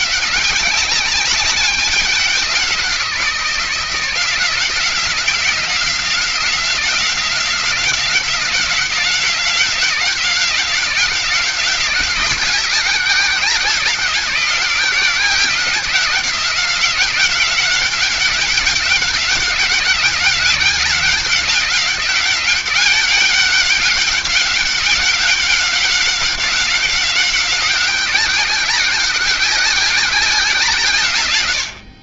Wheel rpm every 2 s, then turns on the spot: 190, 180, 170, 180, 180, 190, 180, 180, 190, 190, 190, 190, 190, 190, 190, 160.
none